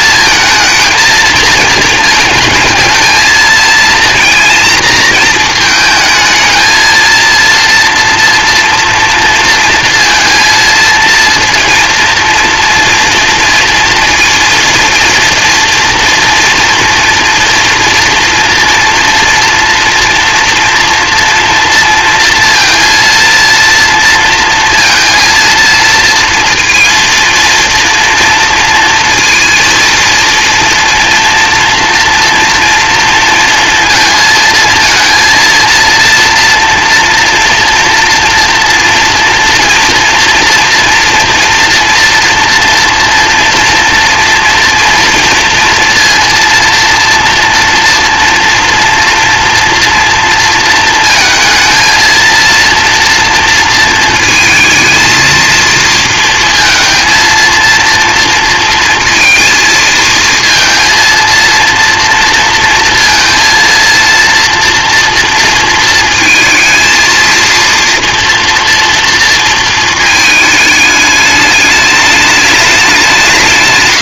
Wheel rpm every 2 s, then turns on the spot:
230, 220, 230, 220, 230, 230, 230, 230, 240, 230, 230, 230, 230, 230, 230, 230, 230, 230, 230, 230, 230, 230, 230, 230, 240, 230, 230, 220, 220, 230, 230, 230, 230, 230, 240, 220, 210.
none